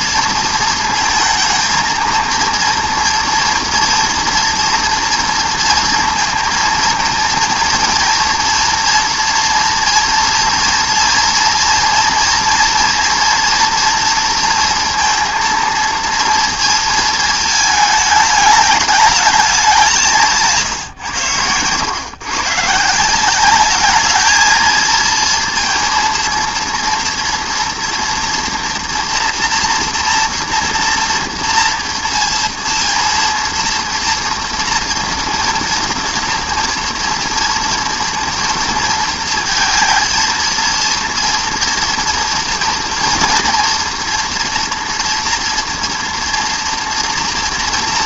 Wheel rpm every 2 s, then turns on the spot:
230, 230, 230, 230, 230, 230, 230, 230, 230, 210, 150, 150, 220, 230, 230, 230, 230, 230, 230, 230, 230, 230, 240, 230.
20-22